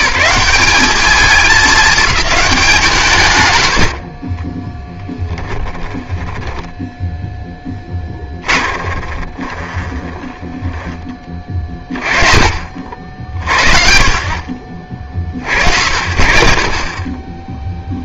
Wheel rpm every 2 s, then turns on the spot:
190, 200, 10, 0, 20, 20, 30, 60, 40.
4-6 8-12